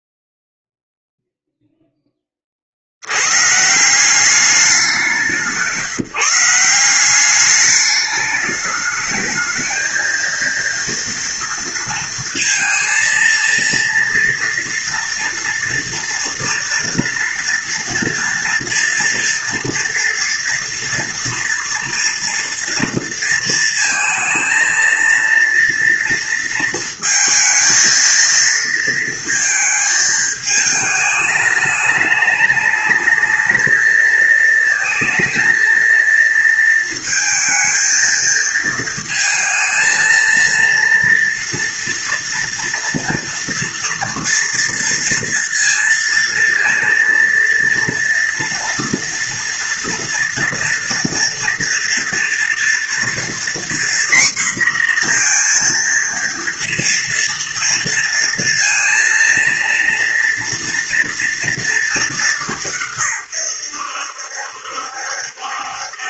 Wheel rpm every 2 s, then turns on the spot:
0, 70, 190, 180, 210, 230, 230, 240, 230, 230, 230, 230, 230, 230, 230, 210, 220, 220, 230, 220, 230, 230, 230, 230, 230, 230, 230, 240, 230, 230, 230, 160, 70.
none